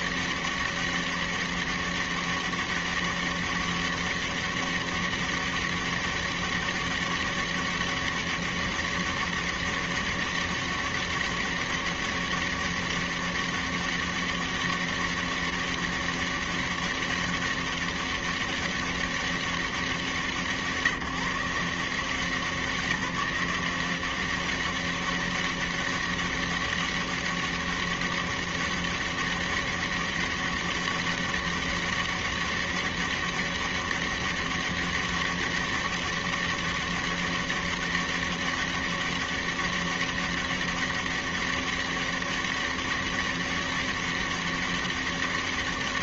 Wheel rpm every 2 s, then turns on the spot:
200, 200, 200, 200, 200, 200, 200, 200, 200, 200, 150, 180, 200, 200, 200, 200, 200, 200, 200, 200, 200, 200, 200.
none